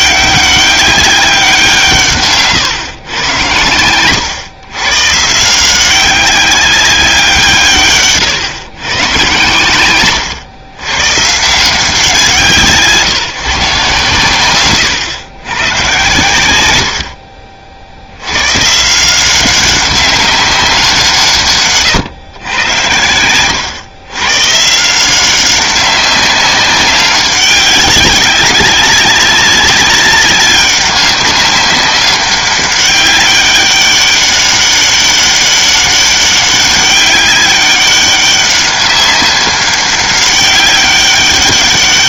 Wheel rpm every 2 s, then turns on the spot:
200, 140, 120, 190, 130, 120, 160, 120, 90, 130, 190, 100, 140, 200, 190, 200, 190, 200, 200, 200, 200.
none